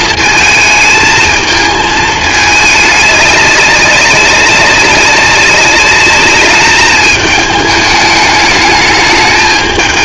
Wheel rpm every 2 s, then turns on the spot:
220, 220, 200, 200, 210.
none